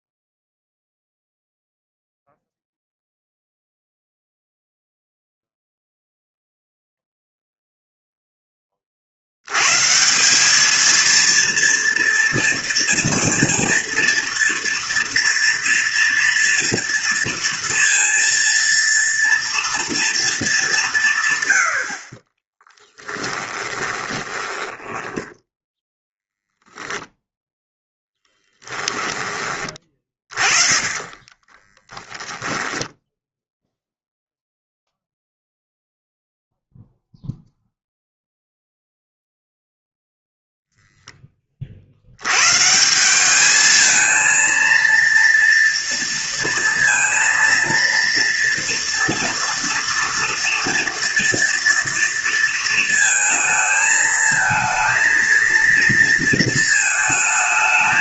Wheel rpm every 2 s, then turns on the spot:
0, 0, 0, 0, 20, 200, 230, 230, 230, 230, 210, 20, 10, 0, 10, 30, 10, 0, 0, 0, 0, 130, 230, 230, 230, 230, 230, 220, 220.
22-26 28-32